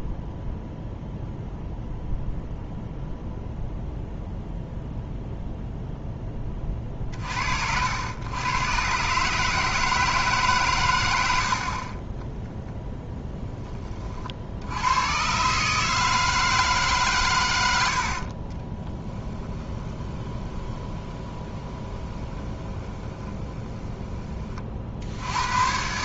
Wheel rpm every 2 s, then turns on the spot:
0, 0, 0, 40, 130, 120, 0, 80, 150, 20, 20, 20, 50.
18-24